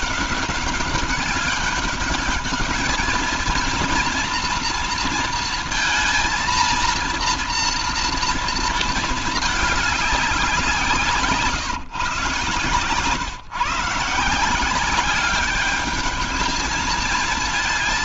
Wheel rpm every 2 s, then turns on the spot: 200, 210, 230, 230, 230, 180, 130, 180, 220.
none